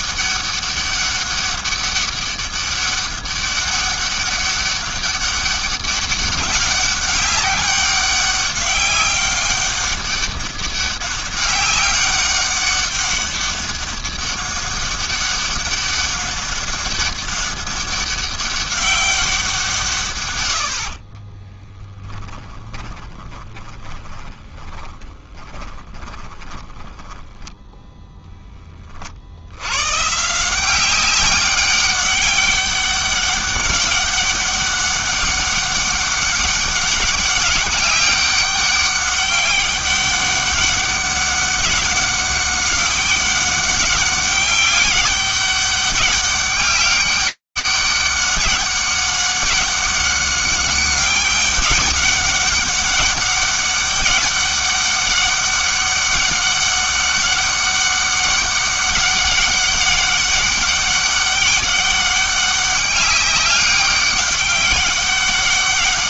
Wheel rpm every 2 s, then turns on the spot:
200, 200, 200, 200, 200, 200, 200, 200, 200, 200, 90, 20, 20, 10, 20, 180, 200, 200, 200, 200, 200, 200, 190, 200, 200, 200, 190, 200, 200, 200, 200, 200, 200.
22-28